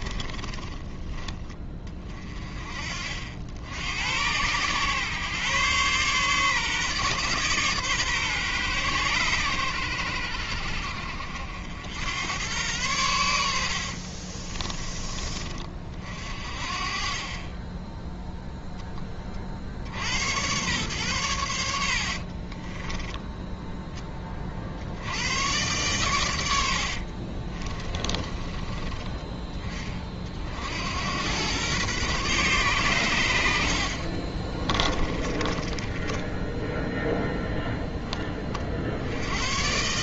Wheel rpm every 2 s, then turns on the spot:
20, 40, 130, 140, 120, 70, 100, 20, 40, 10, 120, 20, 70, 70, 20, 80, 120, 20, 0, 60.
0-2 14-16 22-24 26-28 34-36